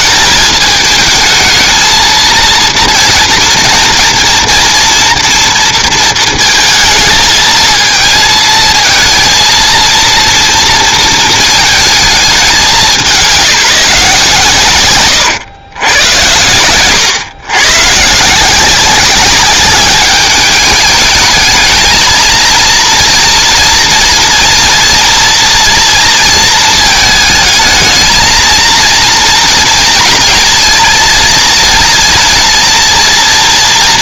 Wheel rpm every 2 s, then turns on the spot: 220, 230, 230, 230, 230, 230, 200, 150, 100, 180, 210, 220, 230, 230, 230, 230, 220.
none